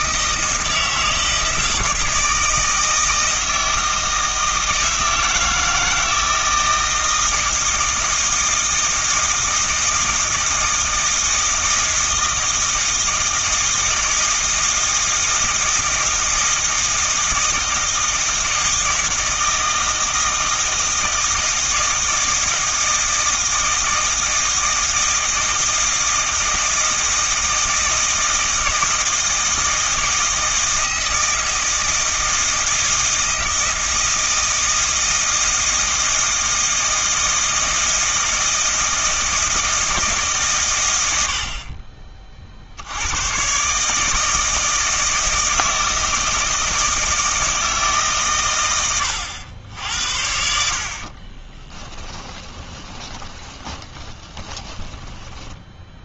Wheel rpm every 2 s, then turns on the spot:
160, 160, 160, 160, 160, 160, 160, 160, 160, 160, 160, 160, 160, 160, 160, 160, 160, 160, 160, 160, 110, 80, 160, 160, 110, 60, 20, 10.
50-56